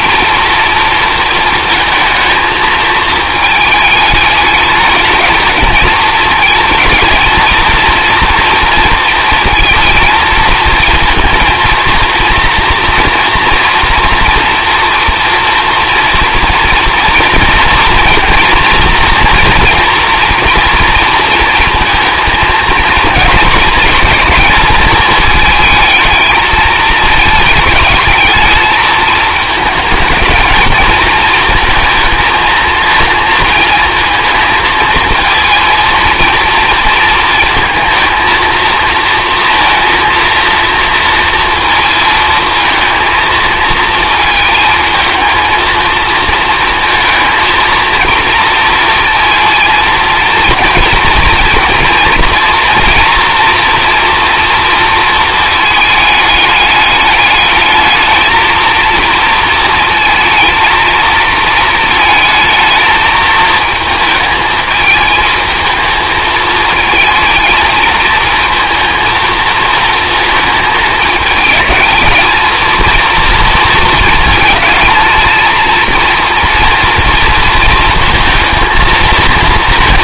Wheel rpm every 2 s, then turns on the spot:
230, 220, 210, 230, 230, 230, 240, 230, 230, 230, 230, 230, 220, 220, 220, 220, 230, 230, 230, 230, 230, 220, 230, 230, 230, 230, 230, 230, 210, 230, 220, 220, 220, 230, 230, 210, 230, 230, 230, 220.
none